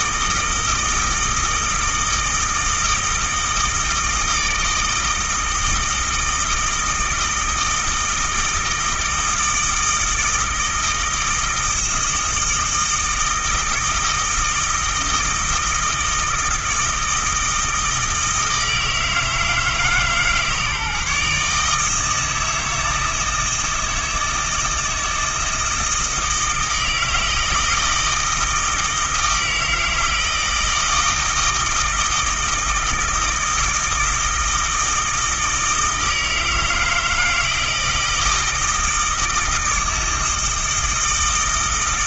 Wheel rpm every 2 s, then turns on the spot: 160, 160, 160, 160, 160, 160, 160, 160, 160, 160, 150, 160, 160, 160, 160, 160, 160, 160, 160, 160, 160.
none